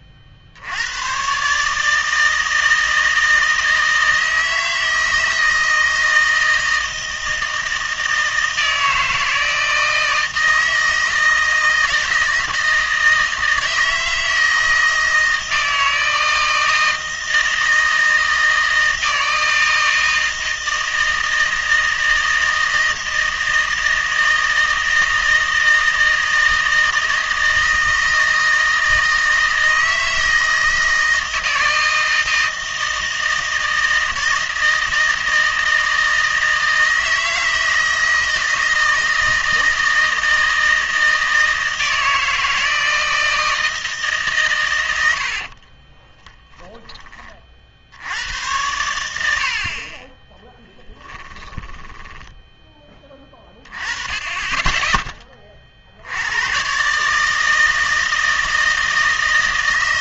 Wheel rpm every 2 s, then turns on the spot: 80, 160, 160, 160, 160, 160, 160, 160, 160, 160, 160, 160, 160, 160, 160, 160, 160, 160, 160, 160, 160, 160, 120, 10, 90, 10, 10, 20, 120, 160.
46-48 50-52